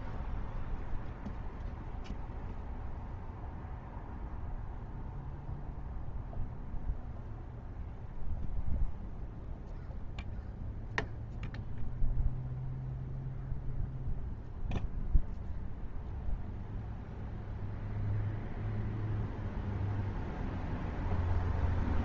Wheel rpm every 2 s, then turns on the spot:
0, 0, 0, 0, 0, 0, 0, 0, 0, 0, 0.
none